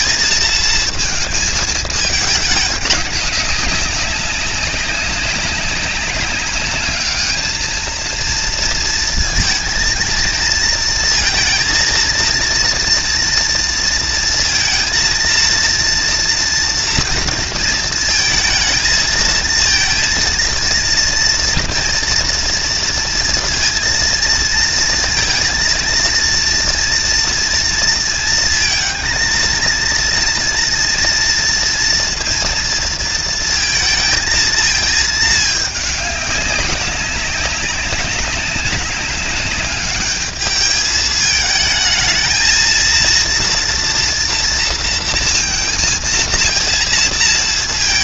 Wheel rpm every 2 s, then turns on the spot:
230, 200, 190, 210, 230, 230, 230, 230, 230, 230, 230, 230, 230, 230, 230, 230, 230, 220, 200, 200, 210, 230, 230, 230.
none